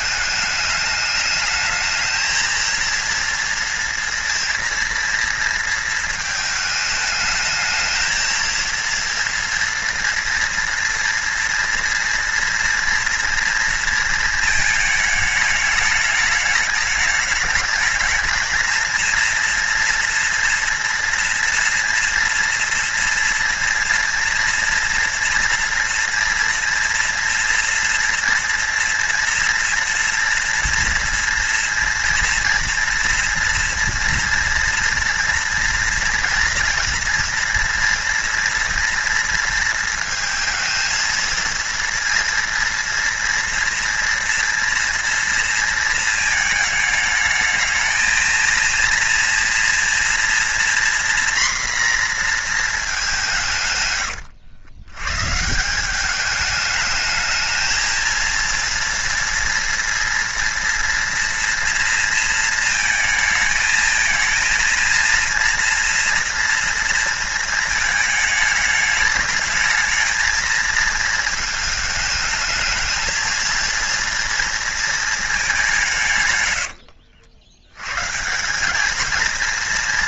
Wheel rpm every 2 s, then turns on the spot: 210, 230, 230, 220, 230, 230, 230, 220, 210, 230, 240, 230, 230, 230, 230, 230, 230, 230, 230, 230, 230, 230, 230, 220, 230, 240, 210, 110, 210, 240, 230, 220, 230, 230, 210, 220, 220, 230, 90, 200.
76-78